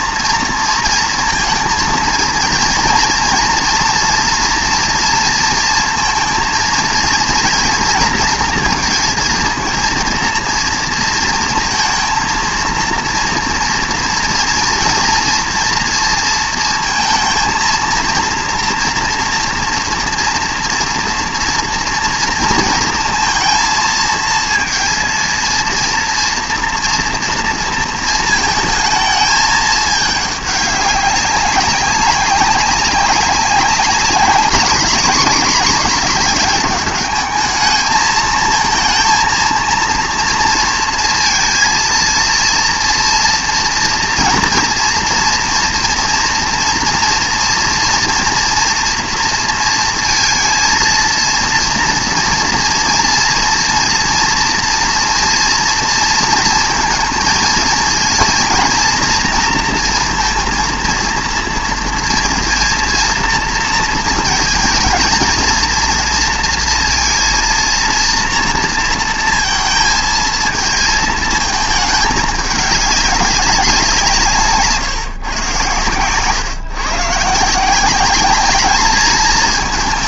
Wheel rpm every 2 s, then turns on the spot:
230, 230, 230, 230, 230, 230, 230, 230, 230, 230, 230, 230, 230, 230, 220, 200, 190, 210, 200, 230, 230, 240, 230, 240, 230, 230, 230, 240, 230, 230, 230, 230, 220, 230, 230, 220, 200, 150, 130, 210.
none